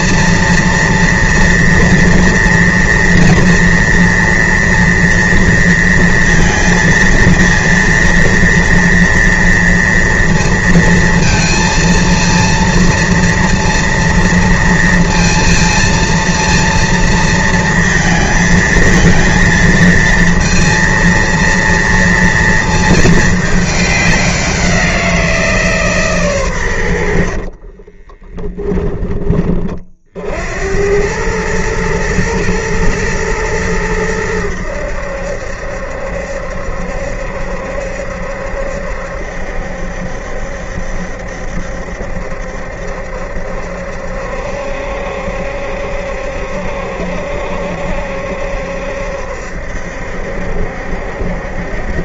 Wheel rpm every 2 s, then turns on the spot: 230, 230, 230, 230, 230, 230, 230, 230, 230, 230, 230, 230, 200, 140, 20, 50, 110, 100, 70, 70, 70, 70, 70, 70, 70, 70.
28-30